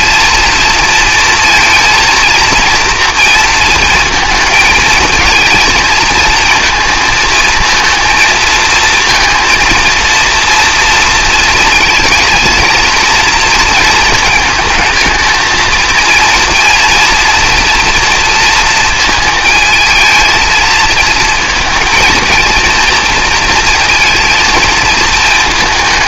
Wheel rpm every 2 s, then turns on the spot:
230, 230, 220, 220, 220, 230, 230, 220, 230, 230, 230, 230, 220.
none